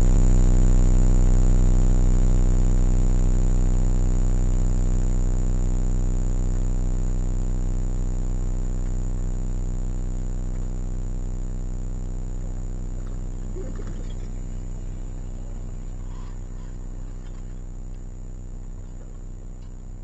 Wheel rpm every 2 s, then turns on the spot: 0, 0, 0, 0, 0, 0, 0, 0, 0, 0.
none